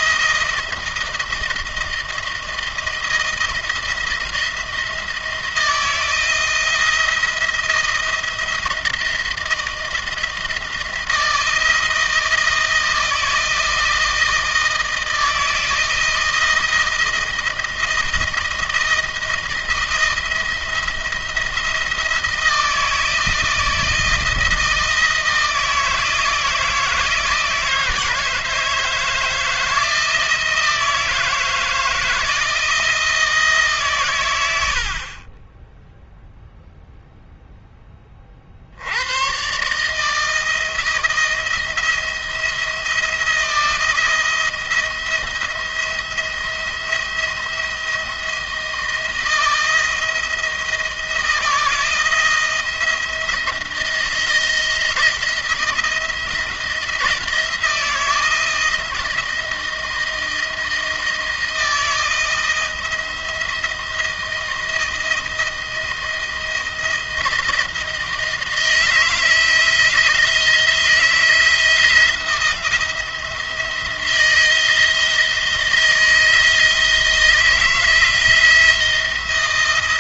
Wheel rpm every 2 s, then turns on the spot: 170, 160, 170, 170, 160, 160, 160, 160, 160, 160, 170, 160, 160, 160, 160, 160, 160, 70, 0, 80, 160, 170, 170, 170, 160, 160, 170, 170, 170, 170, 160, 160, 160, 160, 160, 170, 170, 160, 160, 160.
none